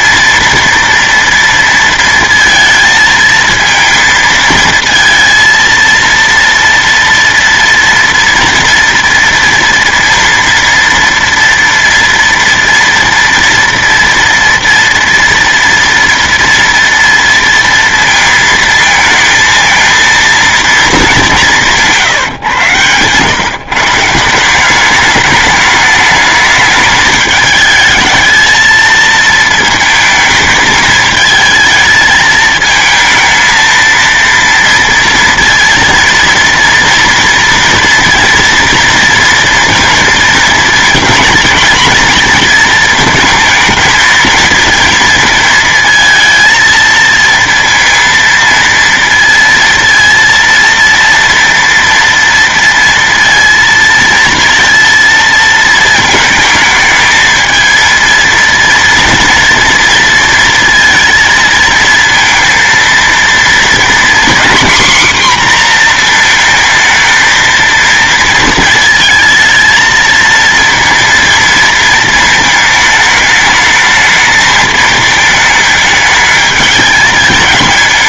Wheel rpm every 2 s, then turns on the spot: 230, 230, 230, 230, 230, 230, 230, 230, 230, 230, 230, 120, 170, 210, 220, 220, 220, 230, 230, 230, 230, 220, 220, 220, 230, 230, 230, 230, 220, 230, 230, 230, 250, 230, 220, 220, 220, 220, 210.
none